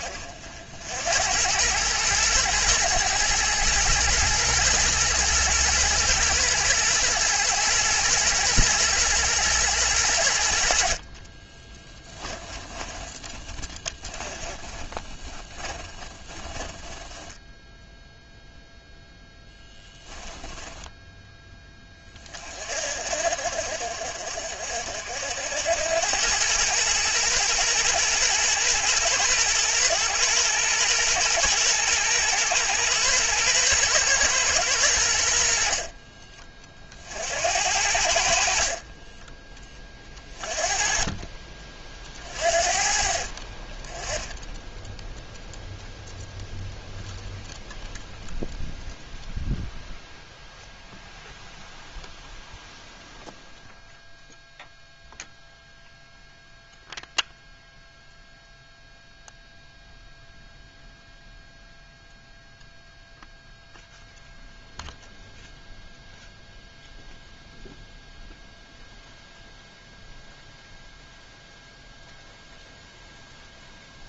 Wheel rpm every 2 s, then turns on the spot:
70, 120, 120, 120, 120, 50, 30, 20, 10, 0, 10, 40, 60, 110, 110, 120, 120, 100, 40, 40, 30, 40, 0, 0, 0, 0, 0, 0, 0, 0, 0, 0, 0, 0, 0, 0, 0.
12-18 20-22 38-40